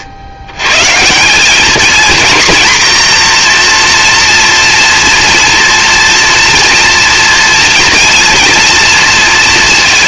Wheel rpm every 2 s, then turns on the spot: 140, 240, 230, 240, 230.
none